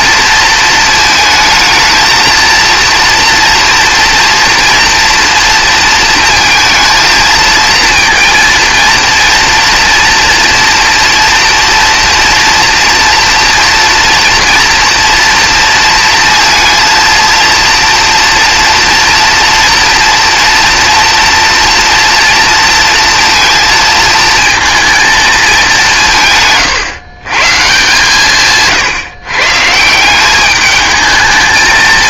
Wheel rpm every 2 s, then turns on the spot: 220, 230, 240, 230, 230, 230, 230, 230, 230, 240, 230, 230, 230, 140, 140, 210.
none